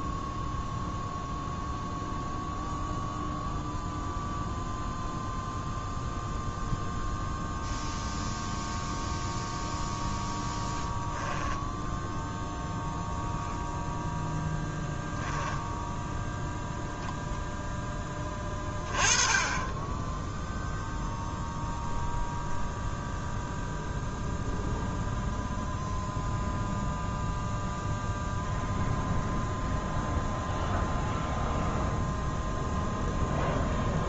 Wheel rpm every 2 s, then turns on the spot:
0, 0, 0, 0, 0, 10, 0, 0, 0, 20, 0, 0, 0, 0, 0, 0, 0.
none